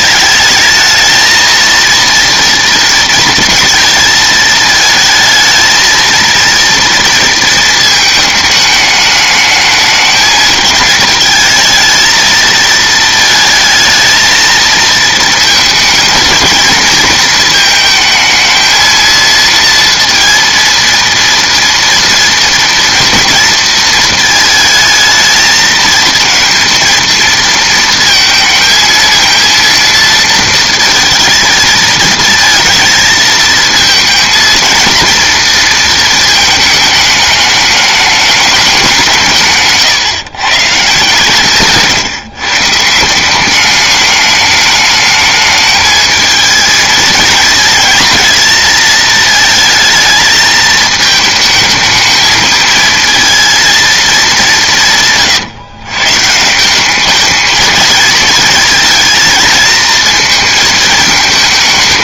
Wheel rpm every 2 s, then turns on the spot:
220, 230, 220, 230, 210, 210, 220, 220, 220, 220, 230, 230, 220, 230, 220, 220, 230, 230, 220, 190, 150, 150, 210, 220, 230, 220, 230, 180, 180, 220, 220.
none